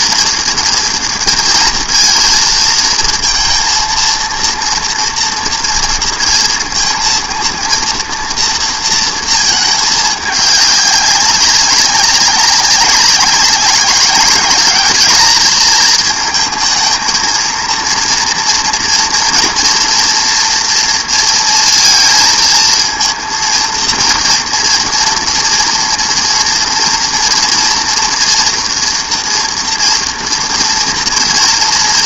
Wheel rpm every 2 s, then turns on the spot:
230, 230, 230, 230, 230, 200, 200, 210, 220, 240, 240, 220, 230, 230, 230, 240.
none